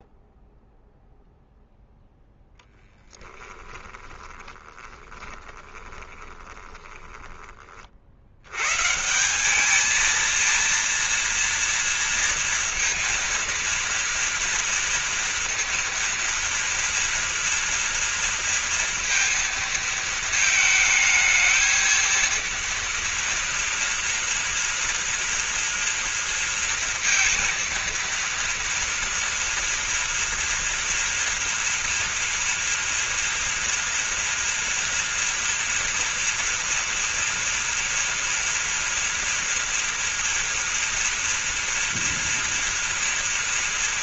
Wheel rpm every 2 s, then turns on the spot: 0, 10, 20, 10, 130, 230, 230, 230, 230, 230, 220, 230, 230, 230, 230, 230, 230, 230, 230, 230, 230, 230.
4-8